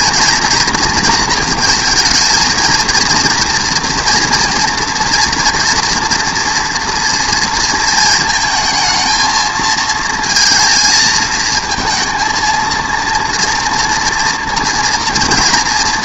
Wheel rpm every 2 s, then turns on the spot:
230, 220, 230, 230, 220, 220, 230, 230.
none